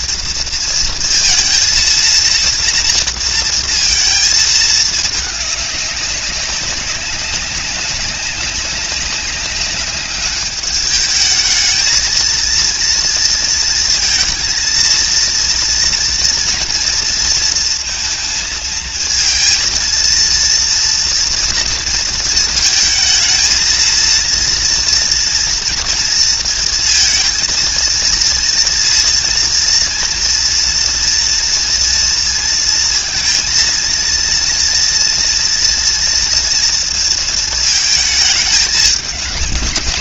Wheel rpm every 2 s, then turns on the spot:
230, 230, 220, 200, 200, 210, 230, 230, 240, 220, 230, 220, 230, 230, 230, 240, 230, 230, 230, 210.
none